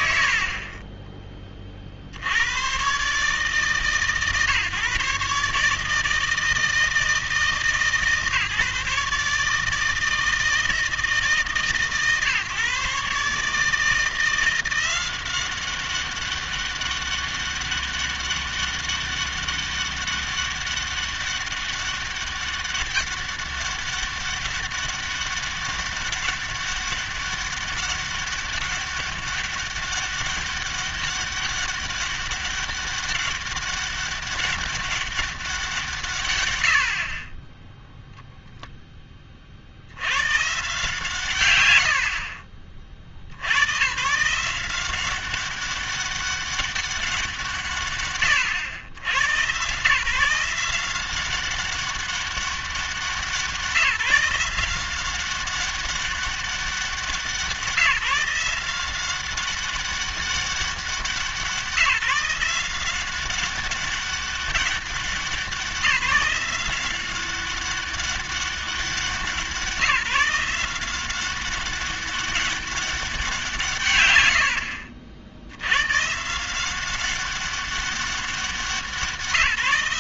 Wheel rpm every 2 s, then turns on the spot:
60, 120, 140, 160, 150, 160, 140, 180, 200, 200, 200, 200, 200, 200, 200, 200, 200, 200, 80, 10, 140, 50, 180, 200, 100, 180, 190, 180, 190, 180, 190, 180, 200, 180, 190, 180, 200, 80, 180, 180.
74-76